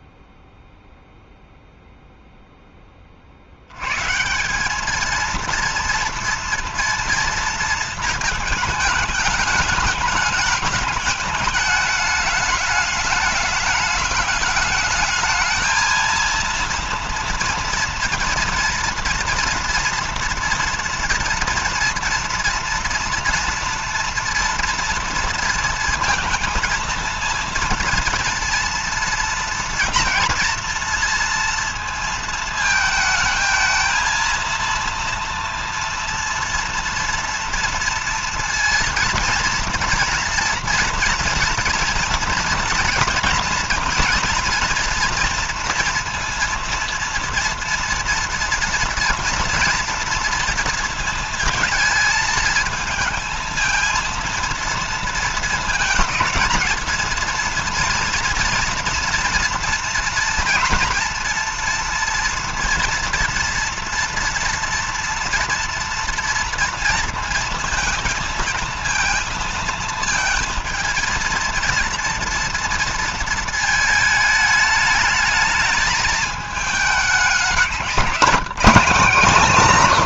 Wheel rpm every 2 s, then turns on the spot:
0, 10, 170, 230, 220, 210, 210, 210, 230, 230, 230, 230, 230, 230, 230, 230, 220, 230, 230, 230, 230, 230, 230, 230, 230, 230, 220, 230, 220, 230, 230, 230, 230, 230, 230, 220, 230, 220, 210, 200.
none